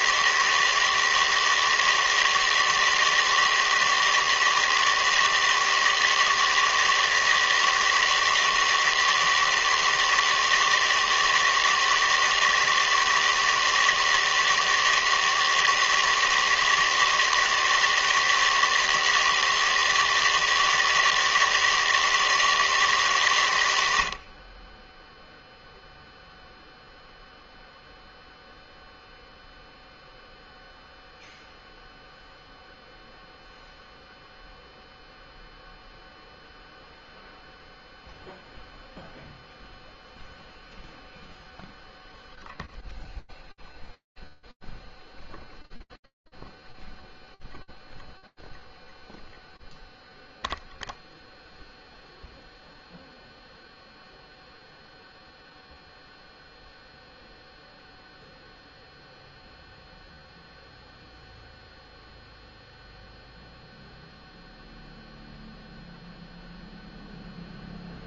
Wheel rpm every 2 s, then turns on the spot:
160, 160, 160, 160, 160, 160, 160, 160, 160, 160, 160, 160, 20, 0, 0, 0, 0, 0, 0, 0, 0, 0, 0, 0, 0, 0, 0, 0, 0, 0, 0, 0, 0, 0.
none